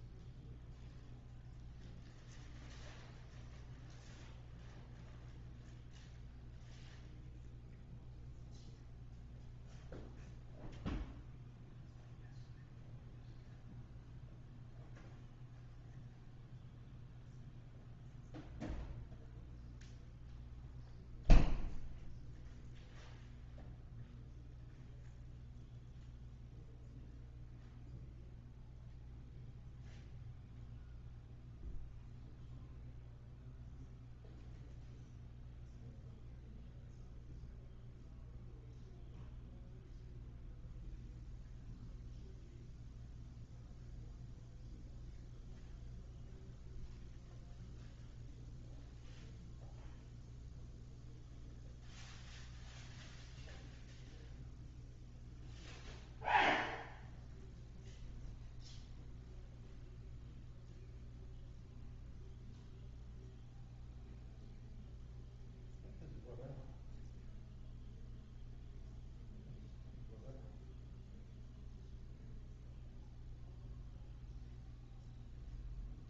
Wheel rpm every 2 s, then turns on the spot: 0, 0, 0, 0, 0, 0, 0, 0, 0, 0, 0, 0, 0, 0, 0, 0, 0, 0, 0, 0, 0, 0, 0, 0, 0, 0, 0, 0, 0, 0, 0, 0, 0, 0, 0, 0, 0, 0.
none